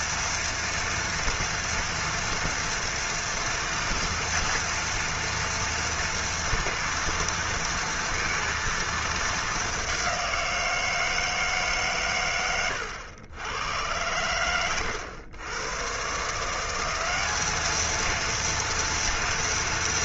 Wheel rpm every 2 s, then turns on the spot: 230, 230, 230, 230, 230, 170, 100, 90, 180, 230.
none